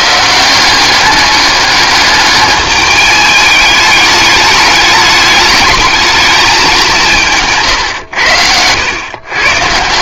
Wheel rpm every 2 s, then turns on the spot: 190, 210, 210, 190, 100.
none